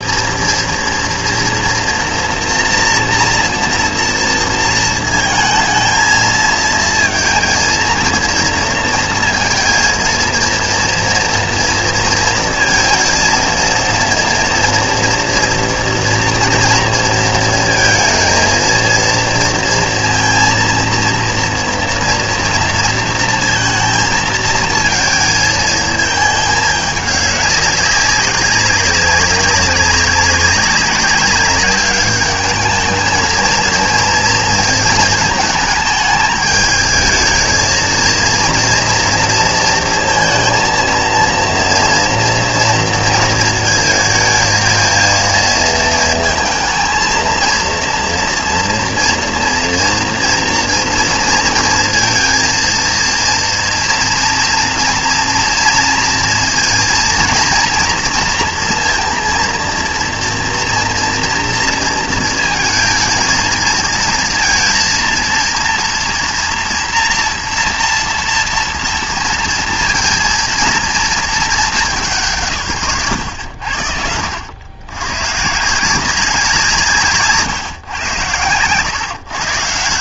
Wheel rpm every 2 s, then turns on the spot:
230, 240, 230, 230, 230, 230, 230, 230, 230, 230, 230, 230, 230, 210, 200, 200, 210, 230, 220, 230, 230, 230, 230, 220, 230, 230, 230, 230, 230, 230, 230, 230, 230, 230, 240, 230, 150, 90, 180, 120.
none